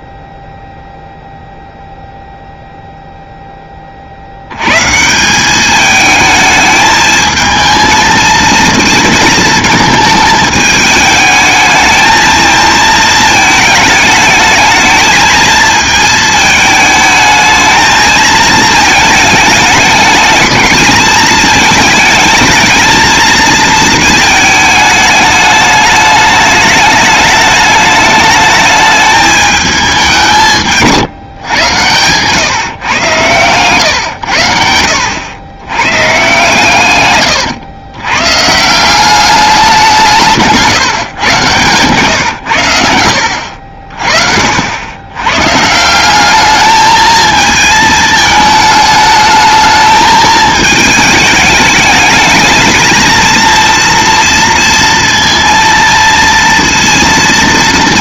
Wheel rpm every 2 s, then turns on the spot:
0, 0, 130, 220, 230, 210, 220, 220, 220, 220, 210, 220, 220, 210, 210, 160, 130, 80, 130, 170, 150, 80, 80, 220, 210, 220, 220, 230, 230.
none